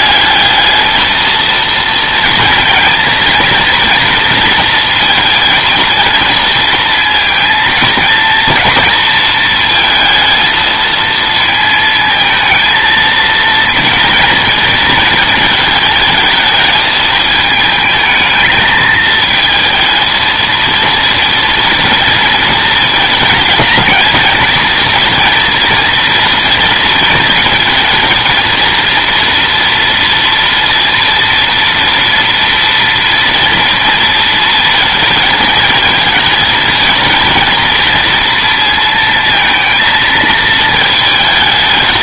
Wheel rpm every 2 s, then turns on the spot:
220, 230, 230, 230, 220, 230, 230, 230, 220, 220, 230, 220, 230, 230, 230, 230, 230, 230, 220, 230, 220.
none